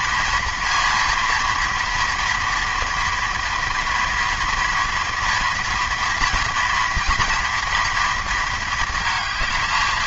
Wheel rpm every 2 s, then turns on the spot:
230, 240, 230, 230, 220.
none